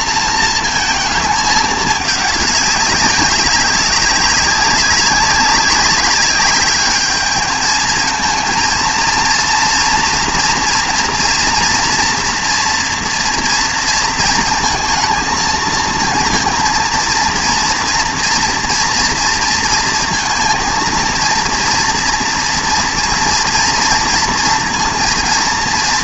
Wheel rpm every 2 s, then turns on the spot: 230, 200, 200, 210, 230, 230, 230, 230, 230, 240, 230, 230, 230.
none